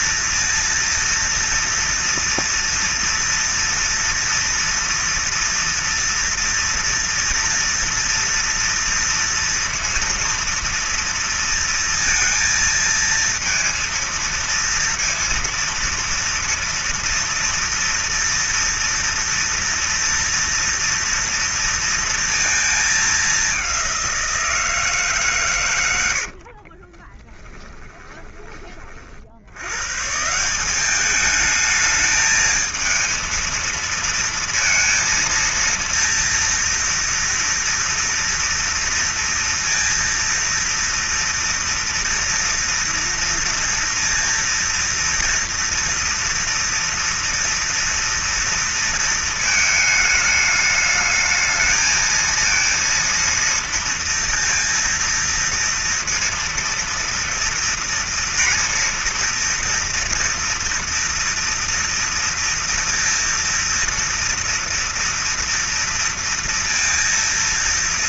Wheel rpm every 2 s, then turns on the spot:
230, 230, 230, 240, 230, 230, 230, 230, 230, 240, 230, 210, 160, 30, 40, 200, 220, 230, 240, 230, 230, 230, 230, 230, 230, 220, 230, 230, 230, 230, 230, 230, 240, 230.
26-28